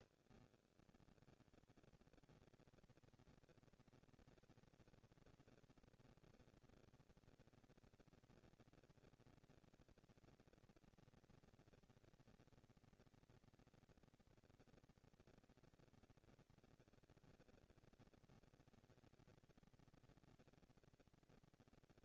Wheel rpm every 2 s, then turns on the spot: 40, 220, 230, 230, 230, 230, 230, 220, 230, 230, 230.
none